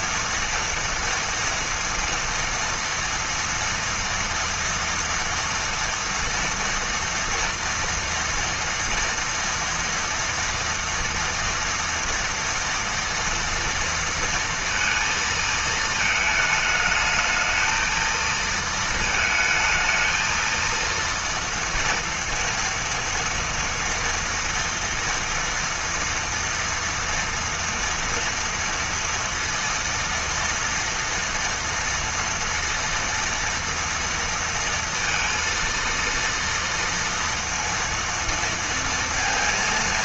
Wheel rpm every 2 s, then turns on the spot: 230, 230, 240, 240, 230, 230, 230, 230, 210, 220, 230, 230, 230, 230, 230, 230, 230, 230, 230, 230.
none